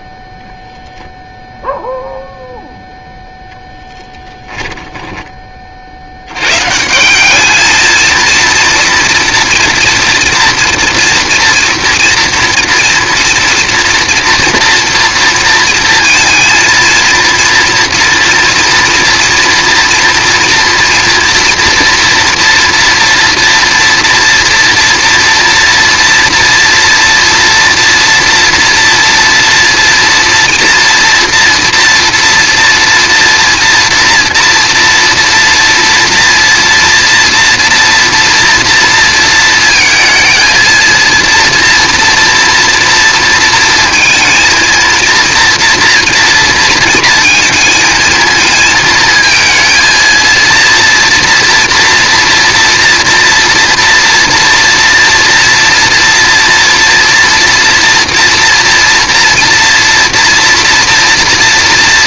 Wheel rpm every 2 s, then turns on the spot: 0, 0, 10, 150, 230, 240, 230, 230, 230, 240, 230, 240, 240, 240, 230, 230, 230, 230, 230, 230, 220, 230, 230, 230, 220, 230, 230, 230, 230, 240, 230.
4-6